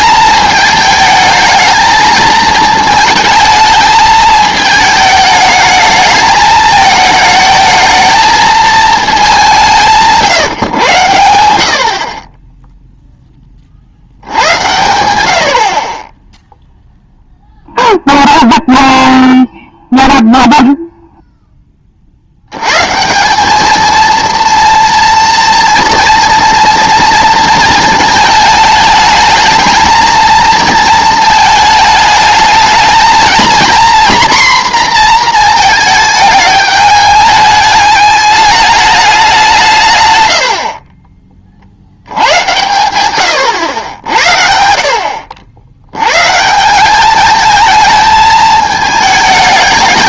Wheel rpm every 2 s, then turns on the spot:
220, 220, 220, 220, 220, 120, 10, 90, 0, 0, 0, 110, 240, 230, 220, 230, 220, 240, 210, 210, 70, 100, 50, 170, 220.
none